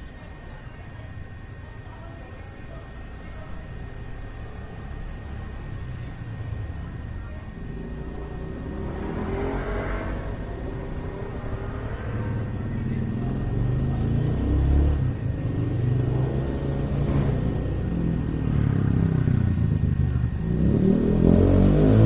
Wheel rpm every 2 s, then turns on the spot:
0, 0, 0, 0, 0, 0, 0, 0, 0, 0, 0.
none